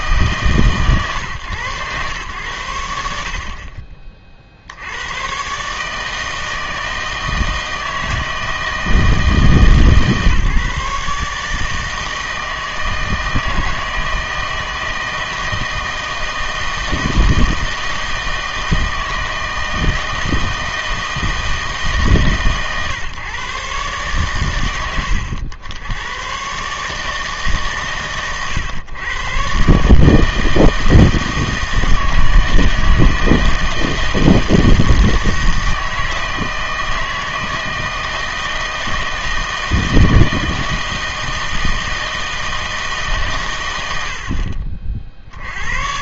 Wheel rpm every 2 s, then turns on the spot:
140, 90, 70, 160, 160, 140, 160, 160, 160, 160, 160, 130, 110, 140, 120, 160, 160, 160, 160, 160, 160, 160, 40.
none